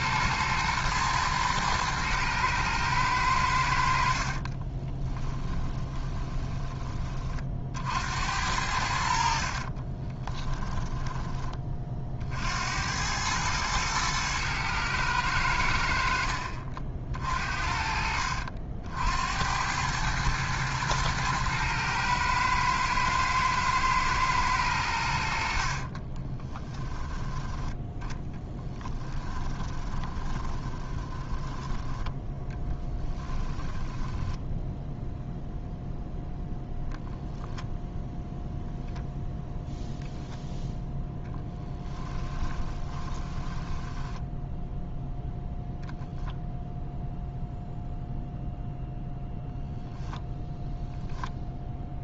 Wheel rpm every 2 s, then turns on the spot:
110, 110, 40, 20, 70, 10, 70, 110, 60, 60, 110, 110, 110, 20, 10, 20, 10, 0, 0, 0, 0, 10, 0, 0, 0, 0.
4-8 10-12 26-34 42-44